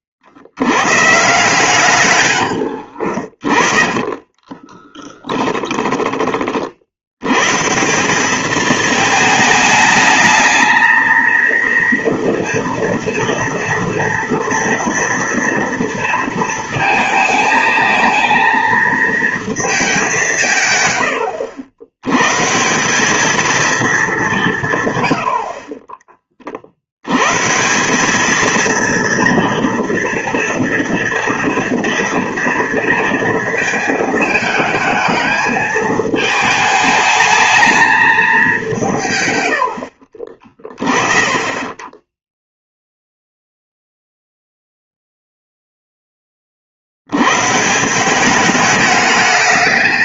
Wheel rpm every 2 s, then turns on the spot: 100, 80, 20, 60, 220, 220, 230, 230, 220, 220, 120, 170, 150, 60, 230, 230, 230, 220, 220, 170, 30, 0, 0, 60, 210.
2-6